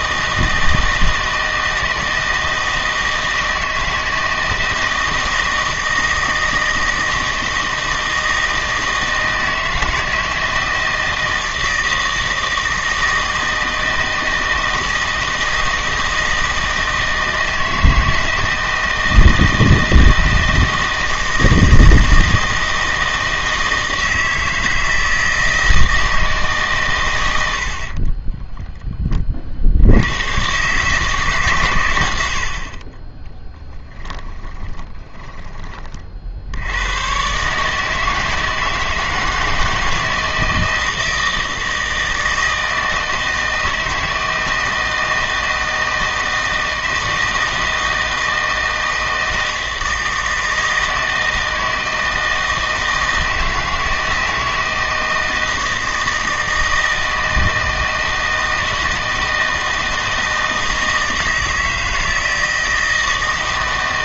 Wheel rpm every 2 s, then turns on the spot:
160, 160, 160, 160, 160, 160, 160, 160, 160, 160, 160, 160, 160, 130, 10, 140, 30, 20, 90, 160, 160, 160, 160, 160, 160, 160, 160, 160, 160, 160, 160, 160.
34-36